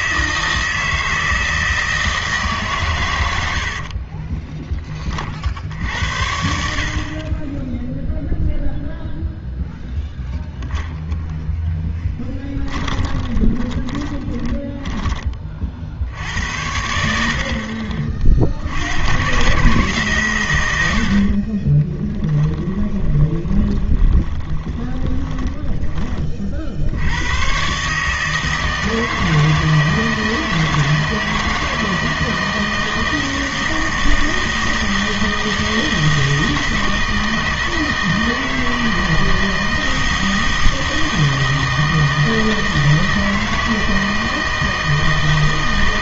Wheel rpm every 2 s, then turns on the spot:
160, 150, 20, 60, 0, 10, 20, 20, 80, 70, 110, 20, 20, 60, 160, 160, 160, 160, 160, 160, 160, 160, 160.
10-16 22-26